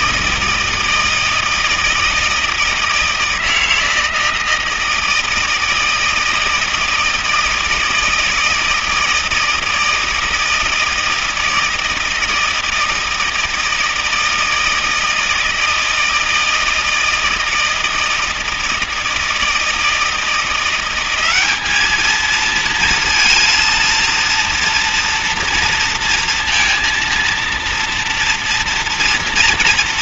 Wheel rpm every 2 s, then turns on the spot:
160, 160, 160, 160, 160, 160, 160, 160, 160, 160, 170, 230, 230, 230, 230.
none